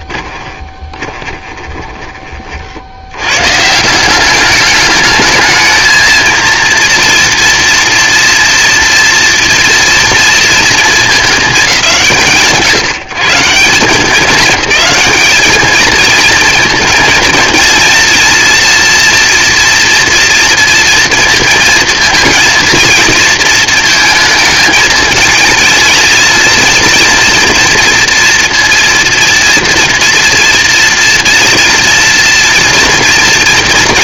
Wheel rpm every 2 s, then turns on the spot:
20, 90, 210, 230, 240, 220, 160, 220, 230, 230, 230, 220, 220, 230, 240, 240, 230.
0-2